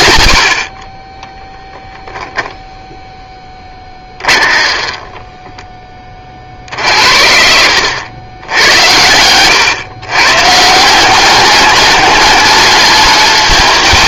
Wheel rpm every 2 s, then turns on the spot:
60, 0, 20, 60, 100, 150, 210.
4-6 8-10